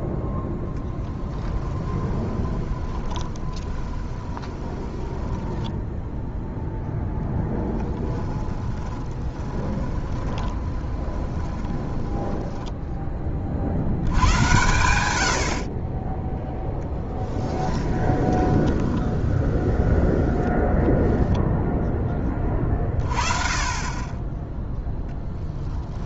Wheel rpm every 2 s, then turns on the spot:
0, 20, 10, 0, 10, 20, 20, 100, 0, 10, 0, 30, 0.
2-6 8-14 18-20